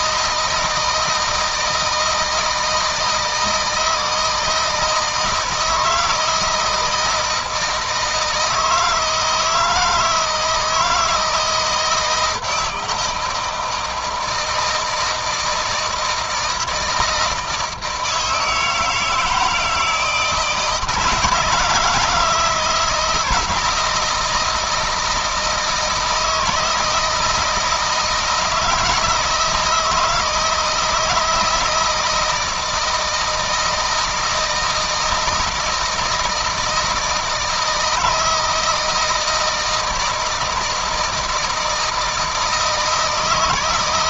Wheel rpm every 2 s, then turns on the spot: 160, 160, 160, 160, 160, 170, 160, 160, 160, 160, 160, 160, 160, 160, 170, 160, 160, 160, 160, 160, 160, 160.
none